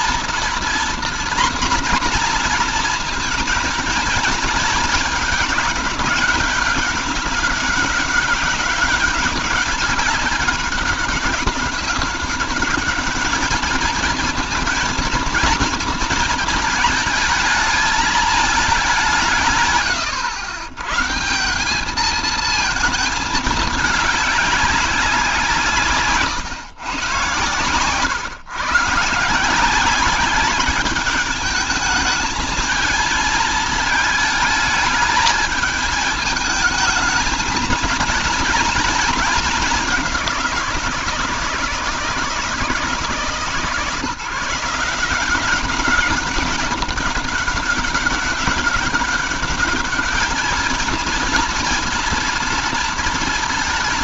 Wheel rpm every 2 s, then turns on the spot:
240, 240, 220, 200, 200, 200, 200, 220, 220, 190, 120, 220, 200, 130, 140, 210, 220, 220, 220, 220, 170, 160, 170, 200, 200, 230, 230.
none